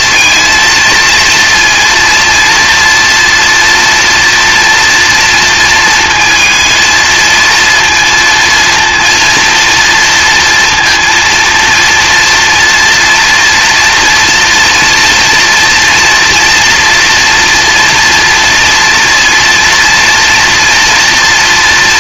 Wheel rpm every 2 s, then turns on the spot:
230, 240, 240, 230, 230, 230, 240, 230, 230, 230, 230.
none